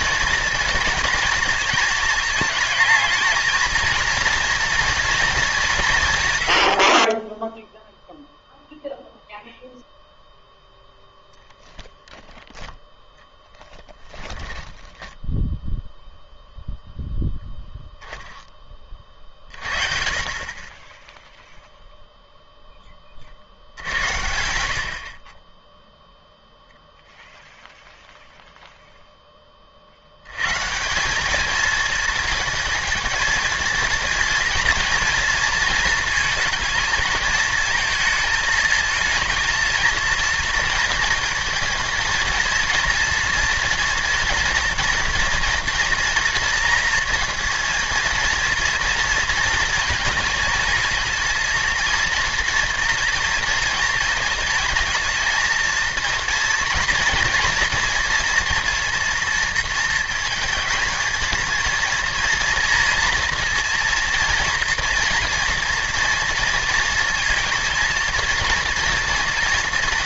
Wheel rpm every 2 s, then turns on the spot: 230, 210, 240, 90, 0, 0, 10, 10, 0, 20, 20, 10, 90, 0, 0, 140, 220, 230, 220, 220, 230, 220, 240, 230, 230, 230, 230, 230, 230, 230, 230, 230, 230, 230, 230.
14-16